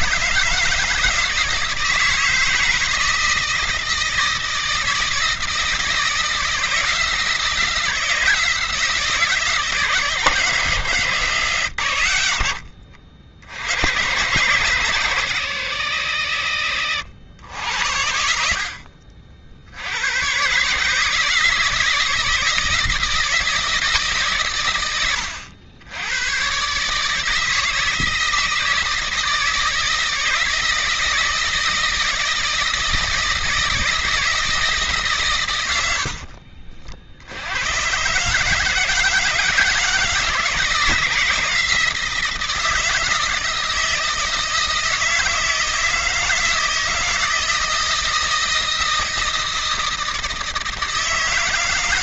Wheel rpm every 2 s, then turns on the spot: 150, 160, 160, 160, 160, 140, 70, 120, 70, 70, 120, 160, 130, 110, 160, 160, 160, 160, 60, 140, 160, 160, 160, 160, 160, 160.
16-18 36-38